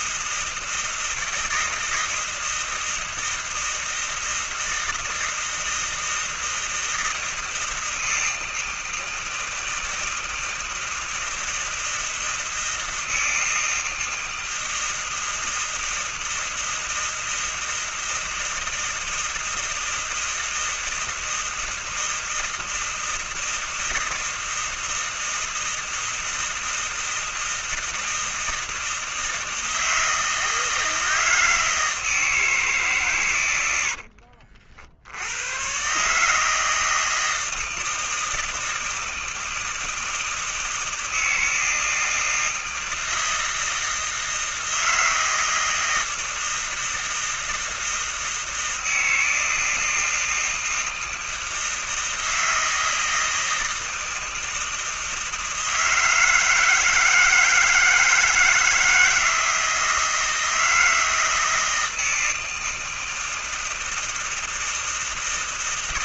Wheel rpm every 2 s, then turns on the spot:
160, 160, 160, 160, 160, 160, 160, 160, 160, 160, 160, 160, 160, 160, 160, 160, 130, 80, 160, 160, 160, 160, 160, 160, 160, 160, 160, 160, 160, 160, 160, 160, 160.
none